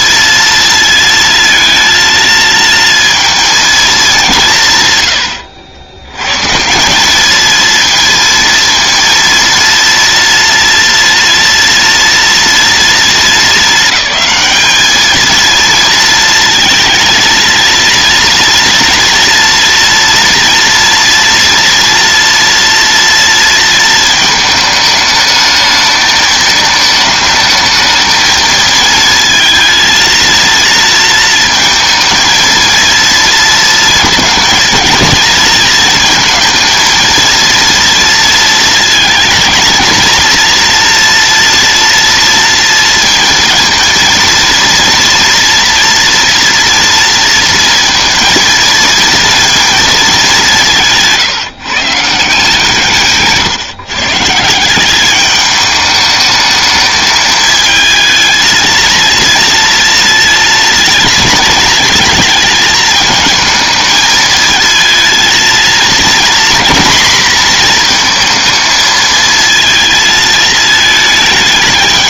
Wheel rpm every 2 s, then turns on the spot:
230, 230, 130, 190, 230, 230, 230, 220, 230, 230, 230, 230, 220, 220, 230, 230, 230, 220, 230, 220, 230, 230, 230, 230, 230, 170, 160, 190, 220, 230, 220, 220, 220, 230, 220, 220.
none